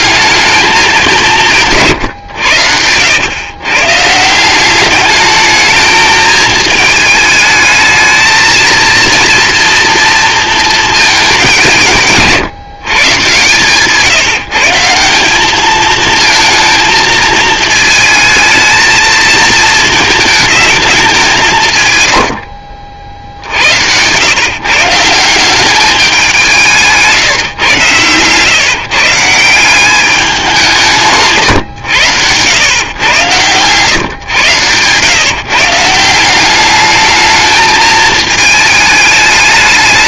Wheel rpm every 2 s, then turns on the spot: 200, 90, 190, 220, 230, 220, 150, 160, 230, 220, 210, 60, 150, 170, 130, 170, 120, 120, 200, 210.
none